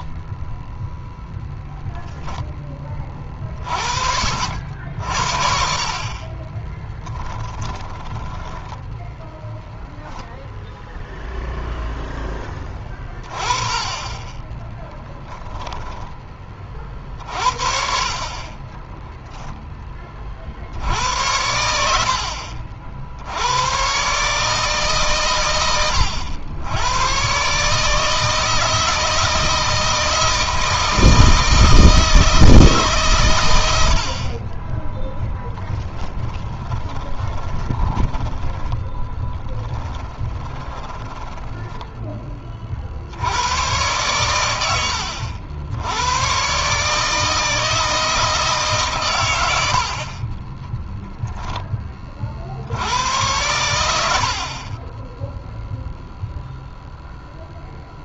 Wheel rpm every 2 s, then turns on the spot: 0, 30, 60, 20, 10, 0, 20, 20, 50, 10, 70, 70, 140, 110, 160, 160, 140, 10, 20, 10, 10, 50, 90, 150, 130, 10, 90, 30, 0.
6-10 14-16 18-20 34-42 50-52 54-56